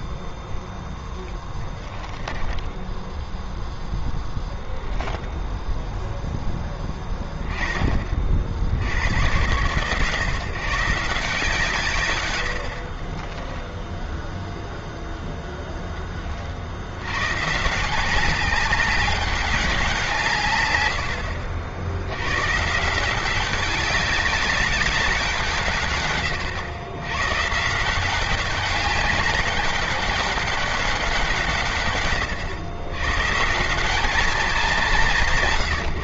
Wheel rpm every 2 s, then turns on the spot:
0, 0, 0, 10, 70, 140, 40, 0, 90, 190, 80, 160, 190, 110, 200, 190, 110, 220.
none